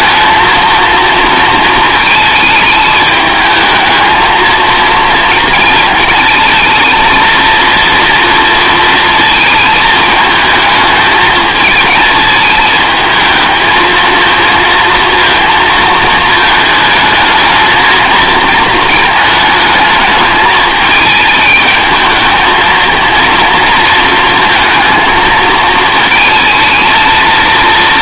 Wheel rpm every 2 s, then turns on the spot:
230, 220, 220, 230, 230, 220, 220, 230, 220, 230, 220, 230, 220, 220.
none